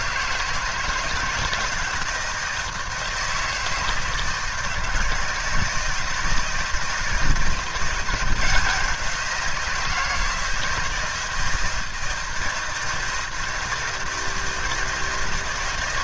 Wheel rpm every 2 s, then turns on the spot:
160, 170, 160, 160, 170, 160, 160, 160.
none